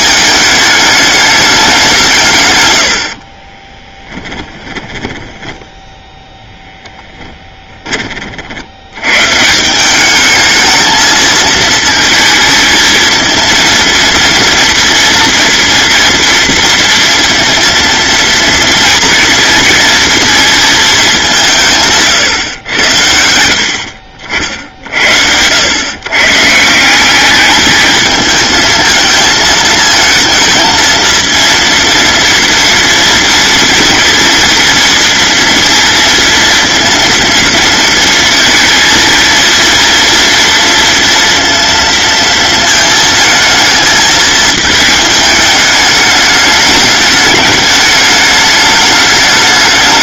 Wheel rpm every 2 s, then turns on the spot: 210, 120, 20, 0, 60, 220, 220, 230, 230, 230, 230, 110, 60, 150, 220, 220, 230, 230, 230, 230, 230, 220, 220, 210, 210.
4-6